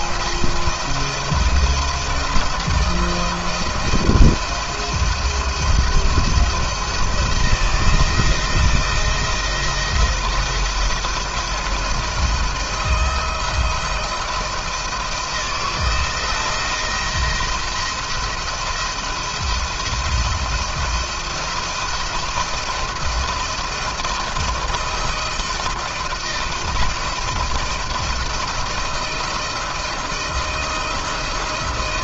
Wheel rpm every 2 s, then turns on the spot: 170, 160, 170, 170, 170, 170, 170, 170, 170, 170, 170, 170, 170, 160, 170, 170.
none